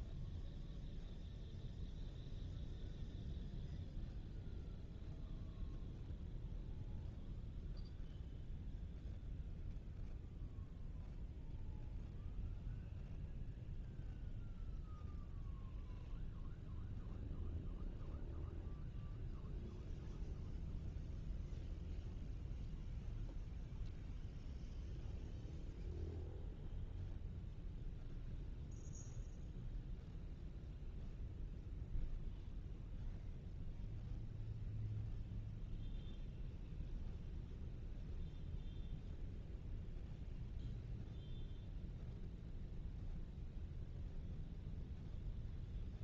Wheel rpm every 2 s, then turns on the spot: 0, 0, 0, 0, 0, 0, 0, 0, 0, 0, 0, 0, 0, 0, 0, 0, 0, 0, 0, 0, 0, 0, 0.
none